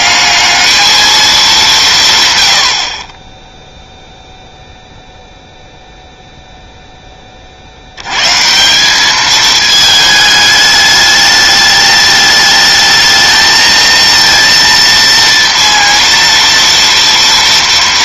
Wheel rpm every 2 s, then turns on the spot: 220, 60, 0, 0, 180, 210, 210, 230, 230.
none